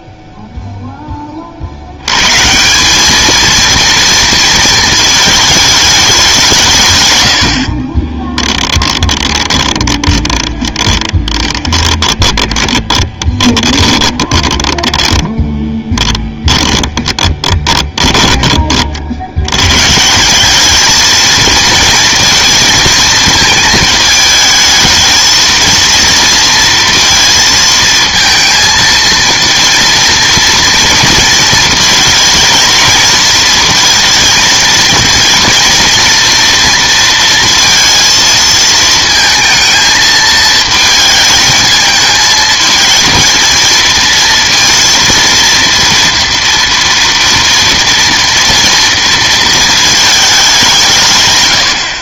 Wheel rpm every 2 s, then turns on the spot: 0, 170, 230, 160, 10, 20, 20, 20, 10, 30, 200, 230, 220, 230, 230, 230, 220, 230, 230, 230, 220, 220, 230, 230, 230, 200.
8-18